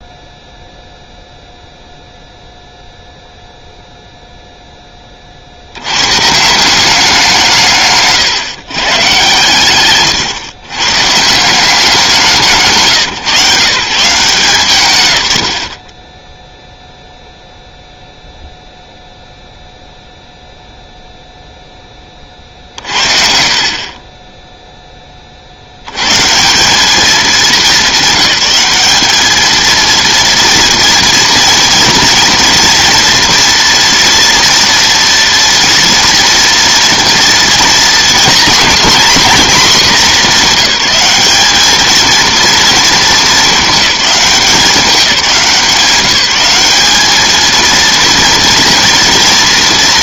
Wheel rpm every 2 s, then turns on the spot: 0, 0, 0, 170, 130, 120, 150, 160, 0, 0, 0, 40, 10, 180, 200, 230, 240, 230, 230, 240, 200, 230, 200, 210, 230.
none